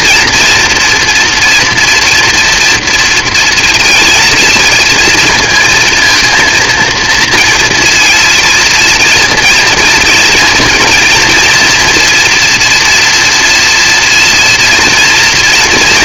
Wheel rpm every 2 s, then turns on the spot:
240, 240, 230, 230, 230, 230, 230, 230.
none